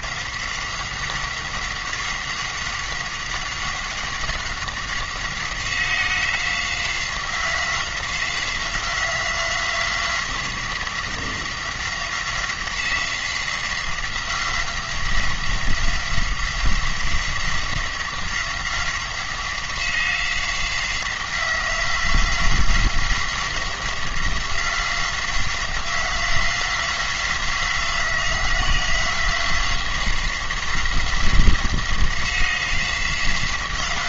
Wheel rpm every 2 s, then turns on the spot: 180, 190, 180, 180, 180, 180, 180, 180, 180, 180, 180, 180, 180, 180, 180, 180, 180.
none